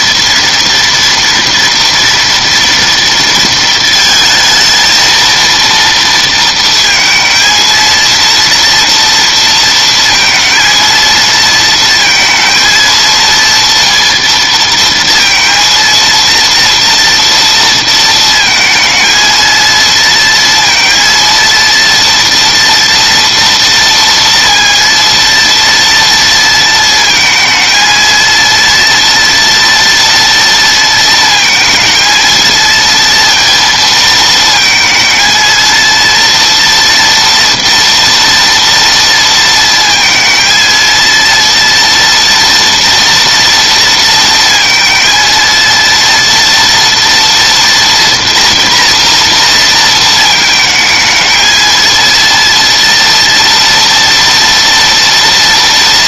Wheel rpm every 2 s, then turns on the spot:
230, 230, 230, 230, 230, 230, 230, 230, 230, 220, 230, 230, 230, 230, 230, 230, 230, 220, 230, 230, 230, 230, 230, 240, 240, 220, 230, 230.
none